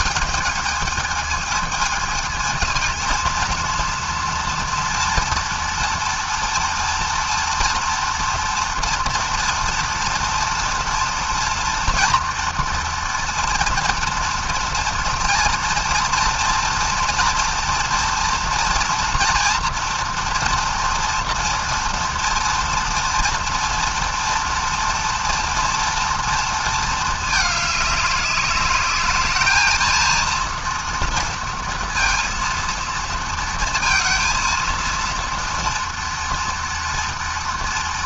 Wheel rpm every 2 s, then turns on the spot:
220, 230, 230, 230, 230, 230, 230, 230, 230, 230, 230, 230, 230, 210, 210, 230, 230, 230, 230.
none